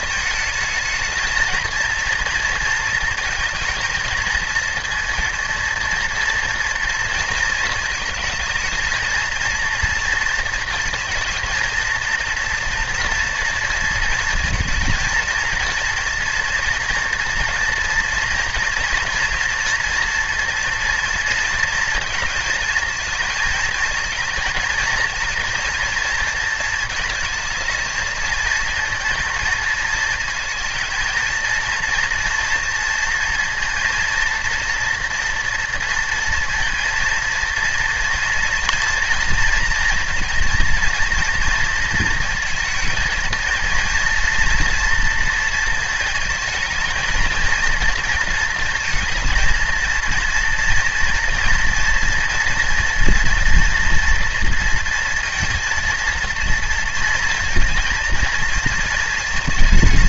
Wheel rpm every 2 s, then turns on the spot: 220, 230, 230, 230, 220, 230, 230, 230, 230, 230, 230, 230, 220, 220, 230, 230, 230, 230, 230, 230, 230, 220, 230, 220, 230, 240, 230, 230, 230, 220.
none